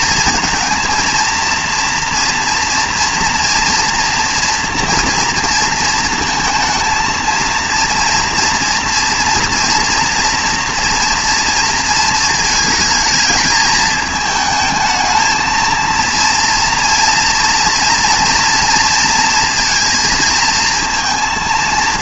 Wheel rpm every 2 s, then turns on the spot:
220, 230, 240, 230, 230, 230, 220, 220, 230, 230, 230.
none